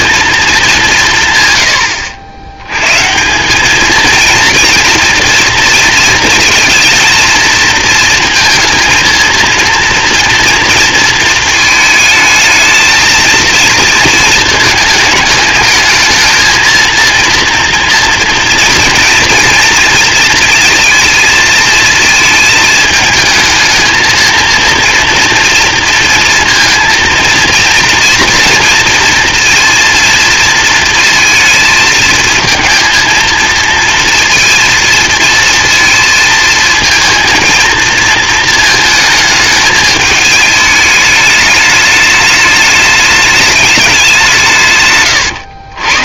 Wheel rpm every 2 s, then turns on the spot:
170, 140, 230, 220, 230, 230, 220, 220, 230, 230, 230, 220, 230, 230, 230, 230, 230, 230, 230, 220, 210, 210, 130.
44-46